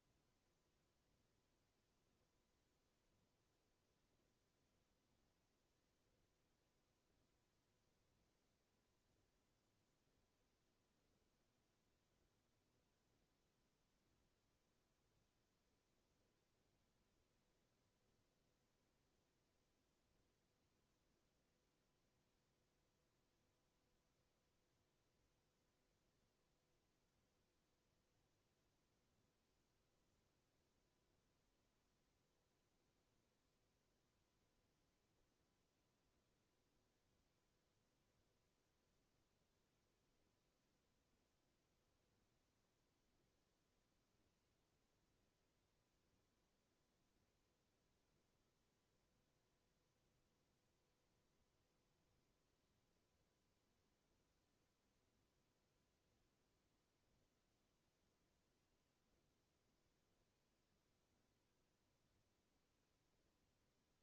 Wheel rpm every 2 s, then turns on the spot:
0, 0, 0, 0, 0, 0, 0, 0, 0, 0, 0, 0, 0, 0, 0, 0, 0, 0, 0, 0, 0, 0, 0, 0, 0, 0, 0, 0, 0, 0, 0, 0.
none